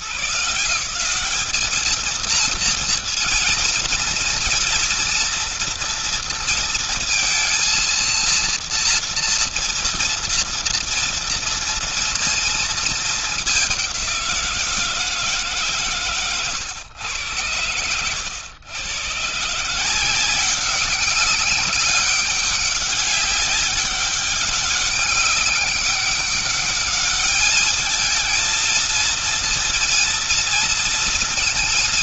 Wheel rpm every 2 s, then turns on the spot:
170, 230, 230, 230, 230, 230, 220, 170, 120, 120, 190, 200, 200, 200, 230, 230.
none